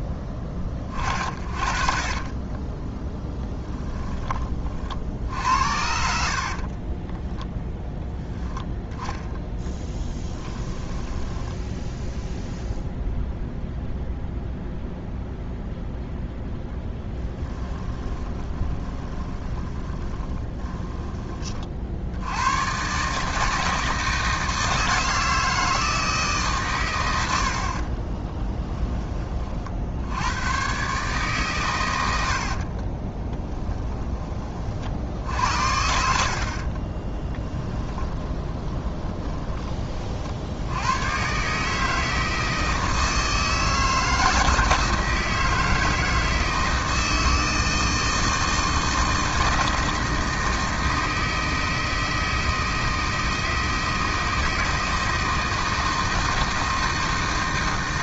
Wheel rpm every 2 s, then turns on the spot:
20, 10, 40, 40, 10, 10, 0, 0, 10, 20, 20, 120, 160, 130, 10, 130, 30, 50, 40, 10, 80, 160, 160, 160, 160, 160, 160, 160, 160.
2-4 6-8 10-12 18-22 32-34 36-40